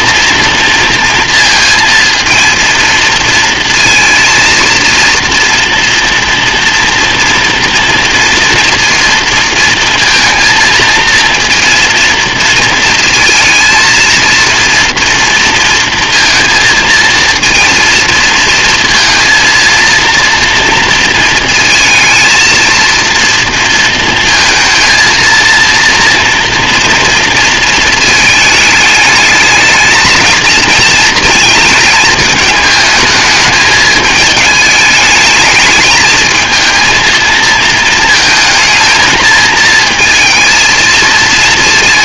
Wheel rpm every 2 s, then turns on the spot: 240, 230, 230, 230, 230, 230, 230, 230, 230, 230, 230, 230, 220, 230, 220, 220, 220, 210, 220, 220, 220.
none